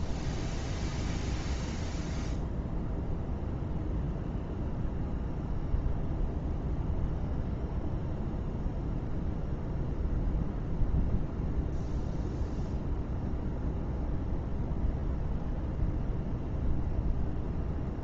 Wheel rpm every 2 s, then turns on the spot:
0, 0, 0, 0, 0, 0, 0, 0, 0.
none